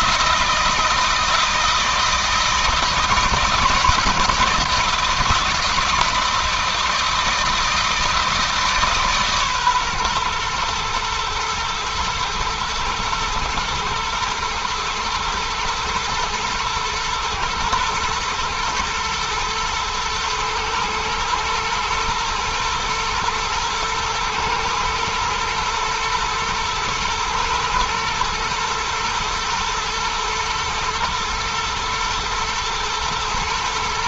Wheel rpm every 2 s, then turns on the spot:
160, 160, 160, 160, 150, 120, 120, 110, 120, 110, 110, 120, 110, 120, 120, 110, 110.
none